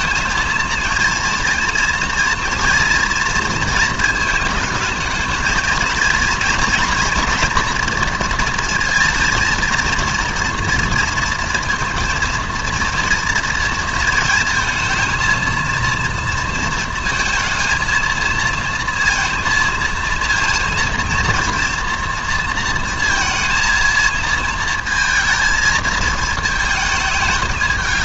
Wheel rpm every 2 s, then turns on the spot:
230, 230, 220, 230, 230, 230, 230, 230, 220, 230, 230, 230, 230, 220.
none